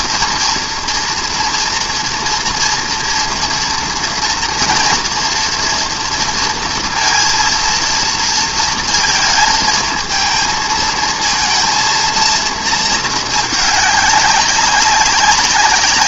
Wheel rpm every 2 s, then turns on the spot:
230, 230, 230, 230, 230, 230, 220, 200.
none